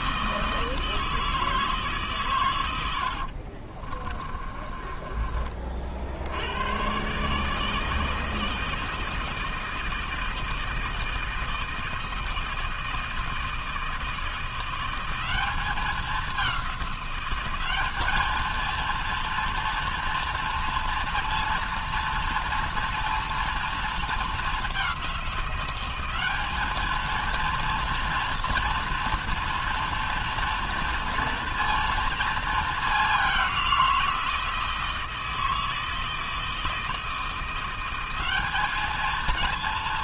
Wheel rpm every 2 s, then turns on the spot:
160, 80, 30, 140, 160, 160, 160, 180, 190, 230, 230, 230, 200, 220, 230, 230, 210, 160, 160, 220.
2-6